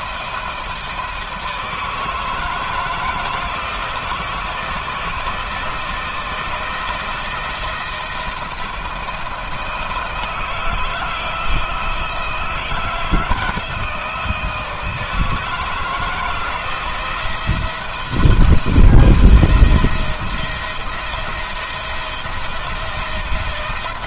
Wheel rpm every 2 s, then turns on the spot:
160, 160, 160, 170, 160, 160, 170, 160, 170, 170, 170, 170.
none